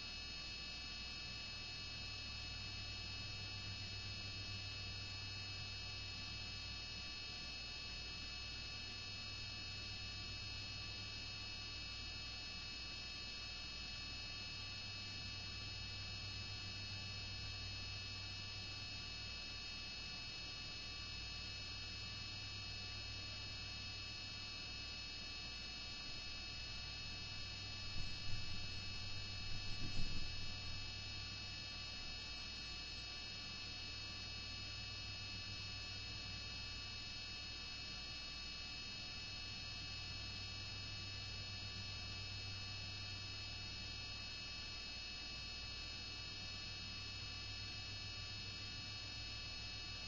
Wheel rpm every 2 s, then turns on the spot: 0, 0, 0, 0, 0, 0, 0, 0, 0, 0, 0, 0, 0, 0, 0, 0, 0, 0, 0, 0, 0, 0, 0, 0, 0.
none